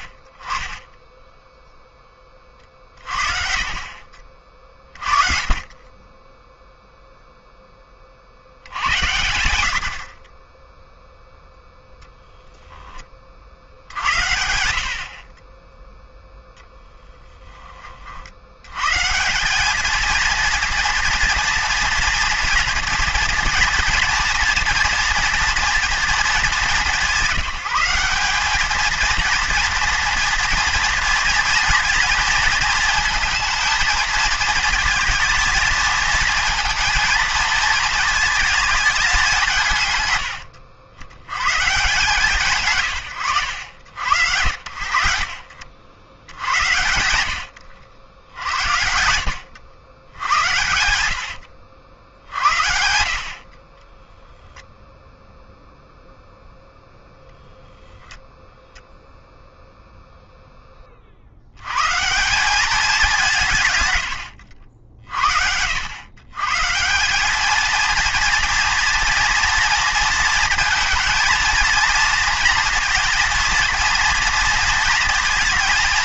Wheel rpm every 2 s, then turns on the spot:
20, 30, 50, 0, 70, 20, 10, 70, 10, 100, 230, 230, 240, 200, 210, 230, 230, 220, 230, 220, 90, 140, 70, 100, 80, 90, 70, 0, 0, 0, 10, 200, 80, 140, 230, 230, 230, 230.
50-54